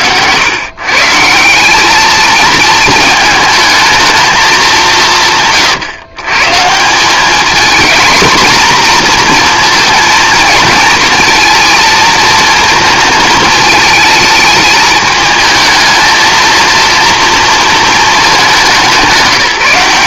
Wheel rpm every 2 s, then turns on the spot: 130, 220, 200, 150, 230, 220, 230, 210, 230, 200.
none